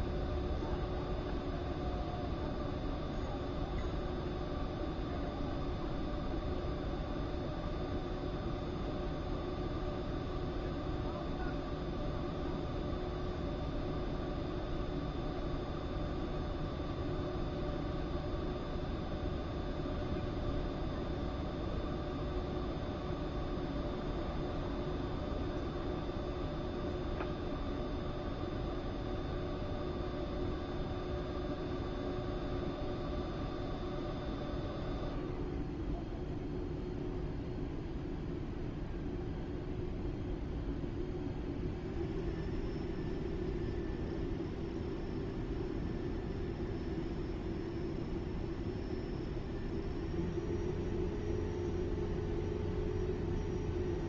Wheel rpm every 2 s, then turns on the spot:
0, 0, 0, 0, 0, 0, 0, 0, 0, 0, 0, 0, 0, 0, 0, 0, 0, 0, 0, 0, 0, 0, 0, 0, 0, 0, 0.
none